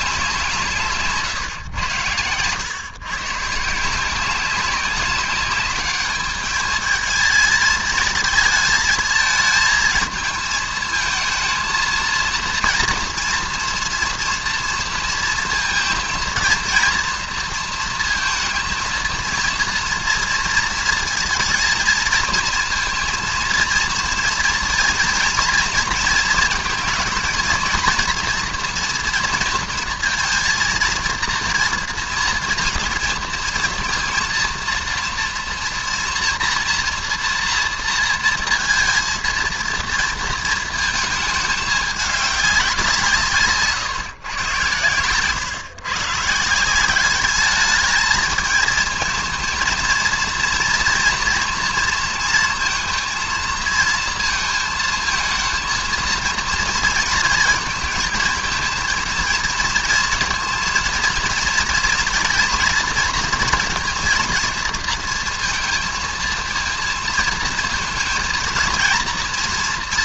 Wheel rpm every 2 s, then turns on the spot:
160, 120, 190, 220, 220, 220, 230, 240, 230, 230, 230, 230, 230, 220, 240, 230, 230, 230, 230, 230, 230, 180, 120, 180, 220, 230, 230, 230, 230, 220, 230, 230, 230, 230, 230.
none